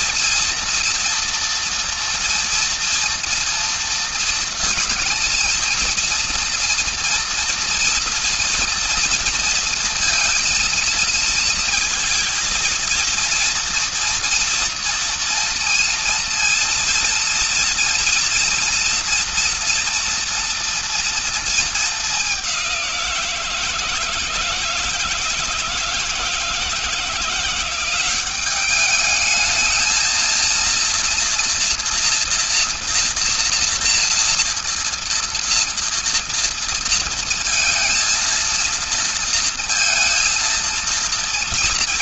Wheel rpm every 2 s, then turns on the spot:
230, 230, 230, 230, 230, 220, 230, 230, 230, 230, 220, 170, 160, 180, 220, 230, 240, 230, 220, 230, 230.
none